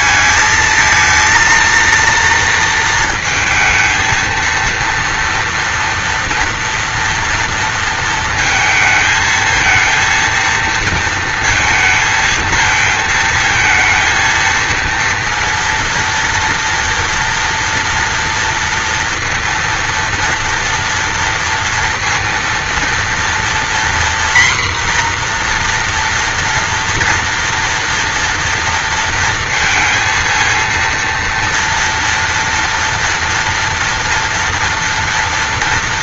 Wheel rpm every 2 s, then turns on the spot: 230, 230, 230, 230, 220, 230, 220, 230, 240, 230, 230, 230, 240, 240, 230, 230, 230, 230.
none